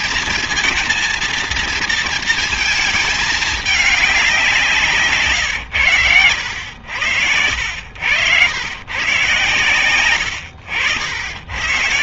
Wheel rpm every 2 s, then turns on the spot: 230, 220, 160, 90, 120, 90.
6-8